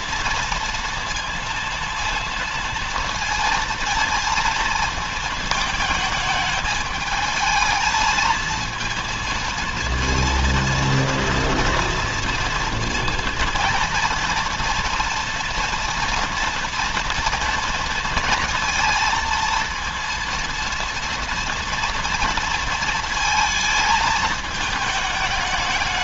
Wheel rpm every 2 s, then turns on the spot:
230, 230, 230, 210, 230, 230, 230, 230, 240, 230, 230, 230, 210.
none